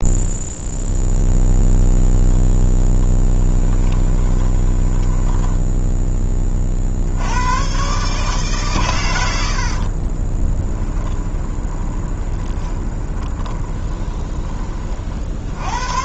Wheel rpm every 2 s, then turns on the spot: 0, 10, 10, 40, 130, 10, 20, 30.
2-6 10-14